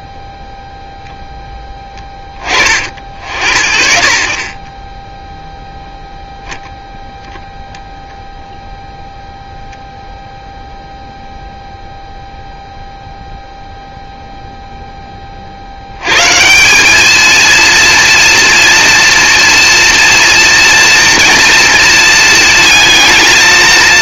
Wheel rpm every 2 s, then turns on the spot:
0, 30, 30, 0, 0, 0, 0, 0, 140, 230, 230, 220.
none